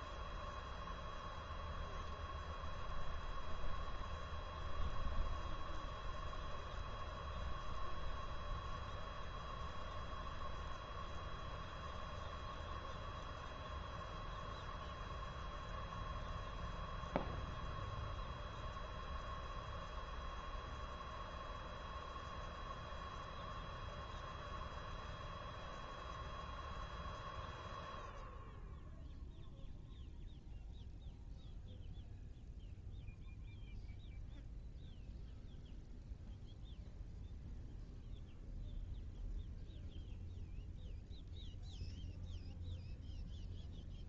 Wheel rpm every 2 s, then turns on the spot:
0, 0, 0, 0, 0, 0, 0, 0, 0, 0, 0, 0, 0, 0, 0, 0, 0, 0, 0, 0, 0, 0.
none